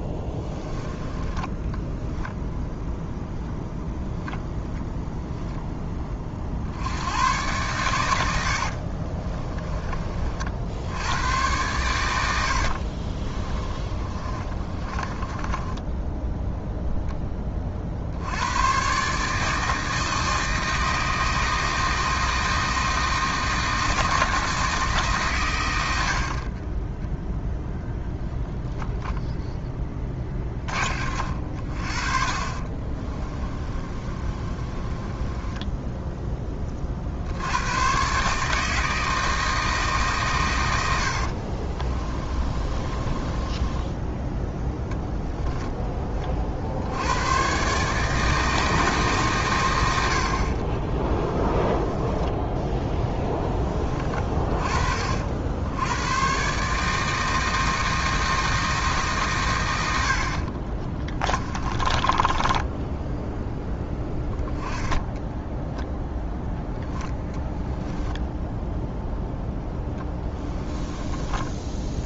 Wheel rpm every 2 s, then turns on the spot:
20, 0, 0, 60, 60, 70, 70, 30, 0, 110, 160, 160, 160, 30, 0, 40, 30, 30, 30, 160, 100, 20, 10, 70, 160, 50, 10, 40, 150, 160, 40, 10, 10, 0, 0, 10.
0-2 8-10 12-16 32-36 42-44 60-64 70-72